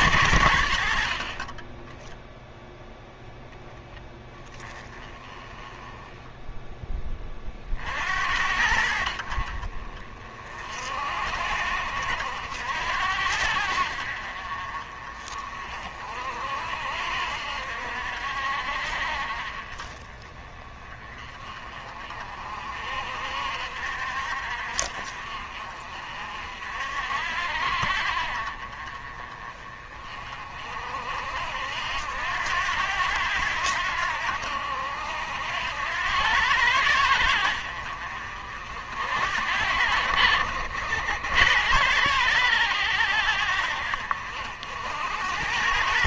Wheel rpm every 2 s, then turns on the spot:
60, 0, 20, 10, 70, 50, 70, 40, 60, 50, 20, 50, 60, 60, 40, 50, 80, 70, 90, 60, 70, 100, 70.
none